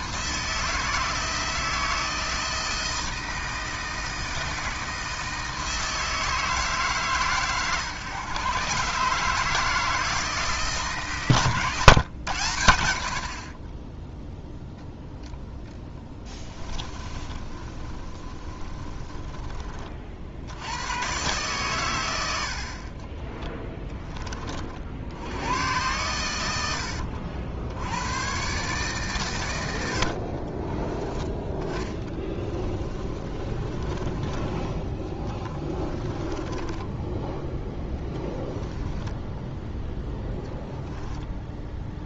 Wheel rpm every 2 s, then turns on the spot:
160, 160, 160, 150, 130, 150, 90, 0, 20, 30, 100, 40, 50, 80, 140, 20, 30, 10, 10, 10, 0.
16-20 30-34 36-40